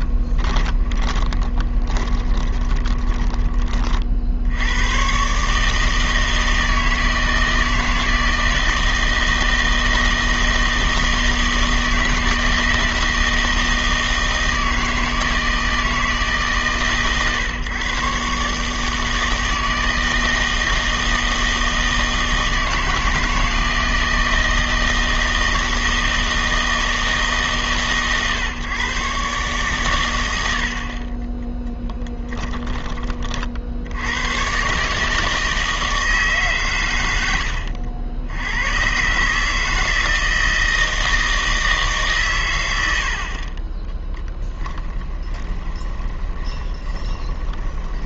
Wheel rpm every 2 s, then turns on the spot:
20, 20, 100, 160, 160, 160, 160, 160, 140, 150, 160, 160, 160, 160, 130, 50, 20, 140, 110, 110, 160, 100, 10, 20.
0-4 44-48